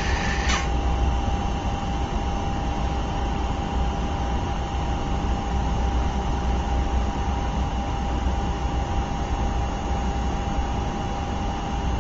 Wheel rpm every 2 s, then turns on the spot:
100, 0, 0, 0, 0, 0.
none